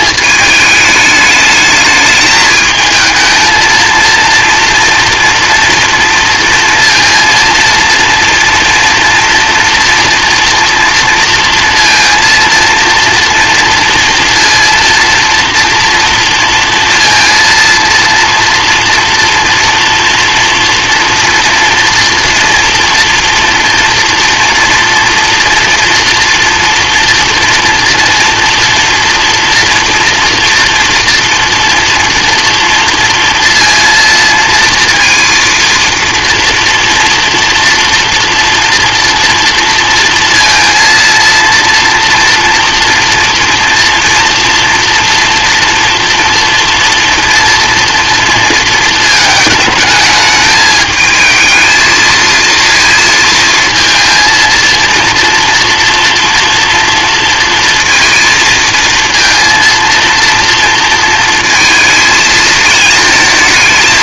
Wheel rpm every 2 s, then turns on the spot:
220, 220, 230, 230, 230, 230, 230, 230, 230, 230, 230, 230, 230, 230, 240, 240, 230, 230, 230, 240, 230, 230, 230, 230, 230, 220, 230, 230, 230, 230, 230, 220.
none